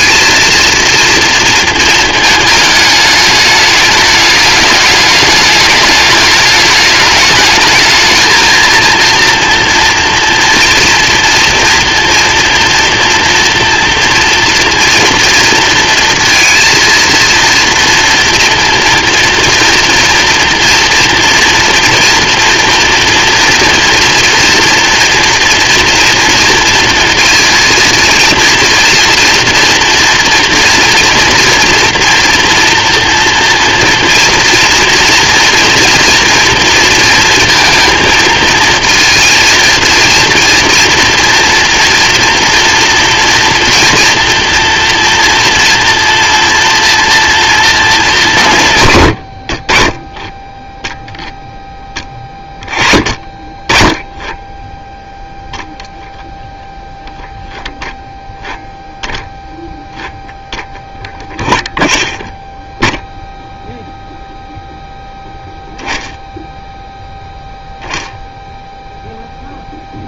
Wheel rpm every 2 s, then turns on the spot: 230, 210, 210, 210, 230, 230, 230, 230, 230, 230, 230, 230, 230, 230, 230, 240, 230, 230, 230, 230, 230, 230, 230, 230, 100, 0, 20, 0, 10, 0, 0, 0, 0, 0, 0.
none